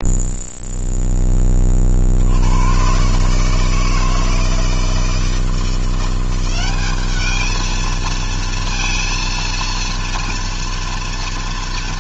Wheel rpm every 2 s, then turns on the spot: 0, 120, 160, 200, 230, 230.
none